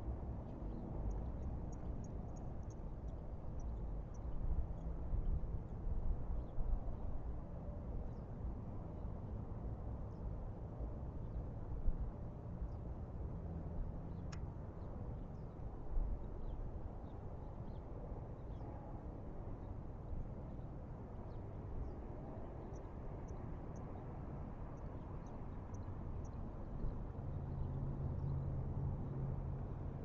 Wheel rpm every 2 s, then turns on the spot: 0, 0, 0, 0, 0, 0, 0, 0, 0, 0, 0, 0, 0, 0, 0.
none